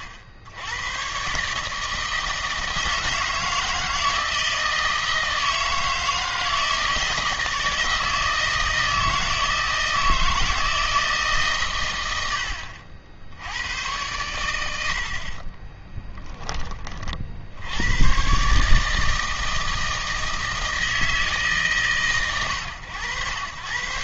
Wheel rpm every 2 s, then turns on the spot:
90, 160, 160, 160, 160, 160, 40, 90, 20, 140, 160, 110.
none